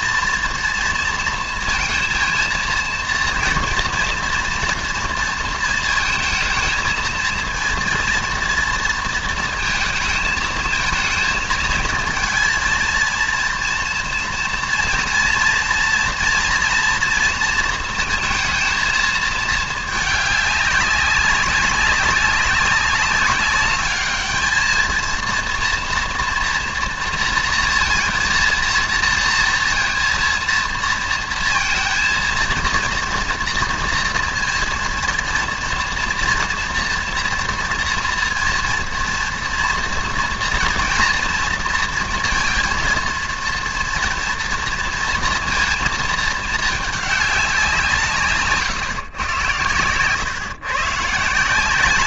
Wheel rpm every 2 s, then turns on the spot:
230, 230, 230, 220, 230, 220, 230, 230, 230, 230, 200, 200, 220, 230, 230, 230, 230, 230, 230, 230, 240, 230, 230, 220, 140, 130.
none